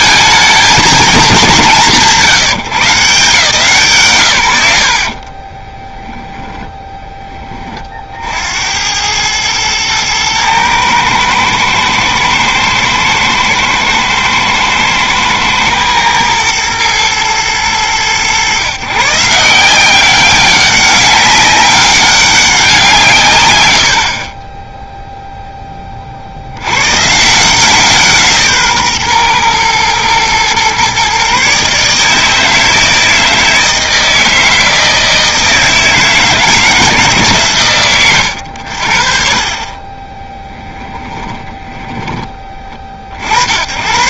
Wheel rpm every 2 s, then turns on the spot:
220, 170, 130, 10, 80, 110, 110, 110, 120, 130, 190, 180, 20, 80, 150, 120, 160, 160, 160, 90, 10, 20.
40-42